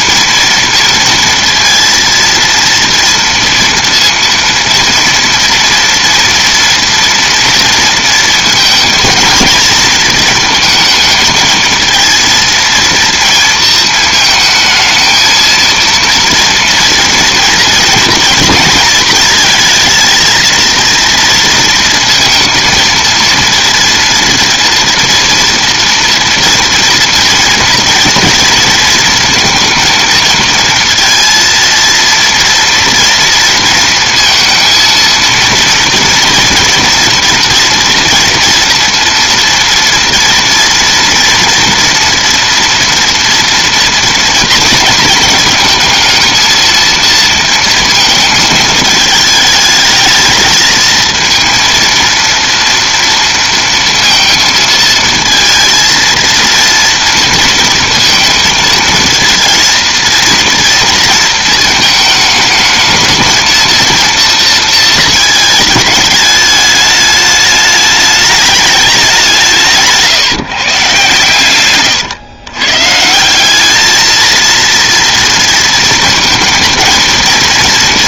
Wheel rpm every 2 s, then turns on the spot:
230, 230, 230, 230, 230, 230, 230, 220, 230, 230, 230, 230, 230, 230, 230, 230, 230, 230, 240, 230, 230, 240, 230, 230, 220, 220, 230, 230, 230, 220, 230, 220, 230, 210, 210, 150, 120, 230, 230.
none